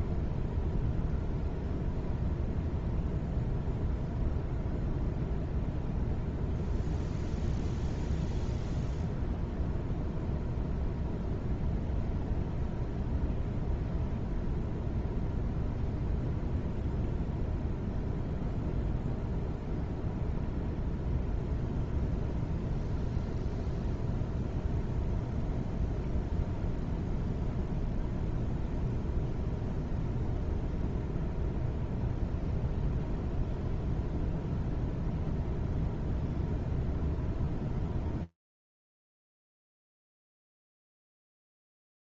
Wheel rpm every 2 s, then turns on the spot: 0, 0, 0, 0, 0, 0, 0, 0, 0, 0, 0, 0, 0, 0, 0, 0, 0, 0, 0, 0, 0.
none